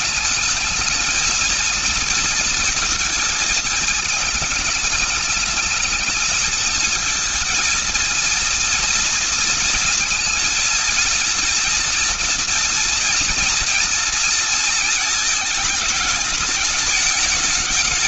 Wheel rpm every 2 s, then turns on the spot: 210, 230, 220, 220, 230, 230, 230, 230, 210.
none